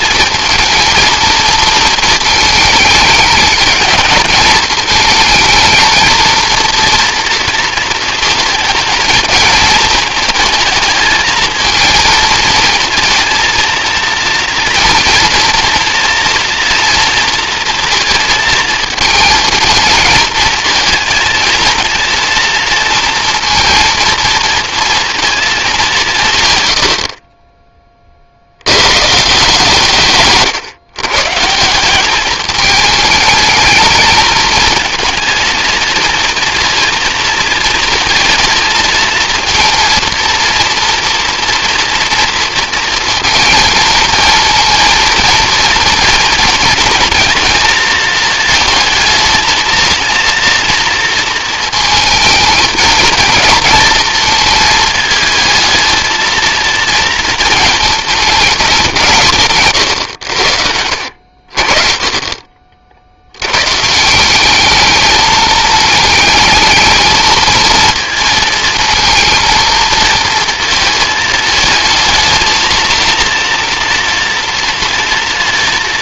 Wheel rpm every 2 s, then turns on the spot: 220, 210, 220, 230, 220, 220, 220, 230, 230, 230, 230, 230, 230, 70, 110, 130, 210, 230, 230, 230, 240, 230, 230, 230, 220, 230, 230, 220, 230, 180, 70, 50, 210, 220, 230, 220, 230, 240.
none